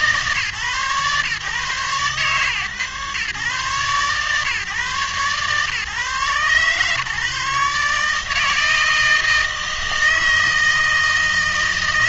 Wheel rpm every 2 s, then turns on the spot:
130, 130, 130, 130, 160, 160.
none